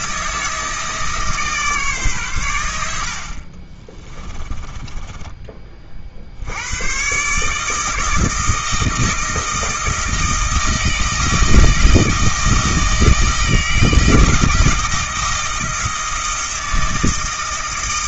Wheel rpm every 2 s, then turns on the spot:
160, 90, 20, 90, 160, 160, 160, 160, 160.
4-6